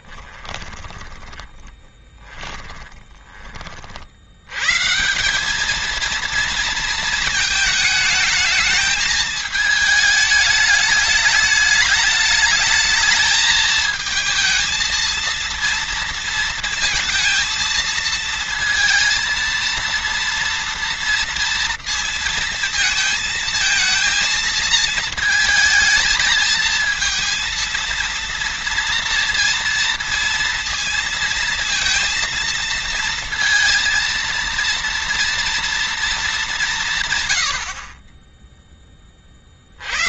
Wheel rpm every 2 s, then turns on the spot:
20, 20, 160, 220, 220, 210, 220, 230, 230, 230, 230, 230, 220, 230, 230, 230, 230, 230, 160, 20.
0-4